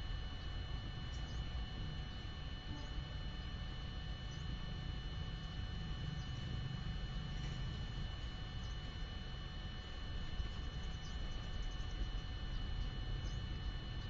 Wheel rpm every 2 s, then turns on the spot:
0, 0, 0, 0, 0, 0, 0.
none